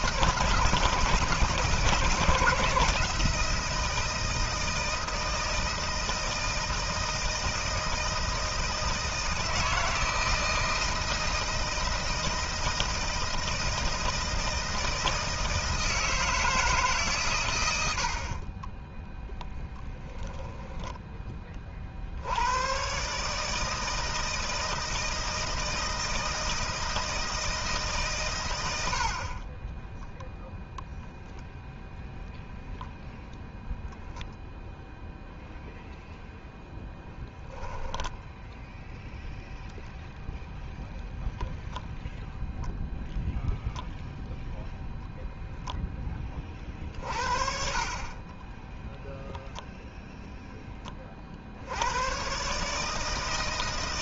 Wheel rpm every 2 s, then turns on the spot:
160, 160, 160, 160, 160, 160, 160, 160, 150, 30, 10, 120, 160, 160, 110, 0, 0, 0, 0, 0, 0, 0, 0, 50, 10, 30, 140.
18-20